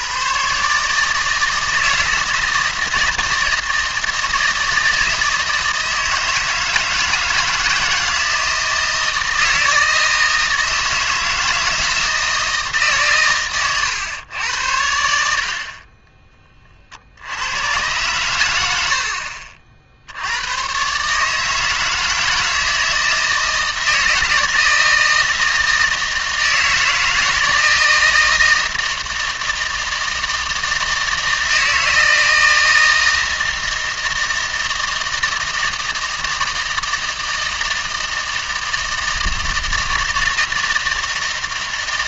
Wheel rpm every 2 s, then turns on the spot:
140, 160, 160, 160, 160, 160, 150, 80, 30, 90, 110, 160, 160, 160, 160, 160, 160, 160, 160, 160, 160.
none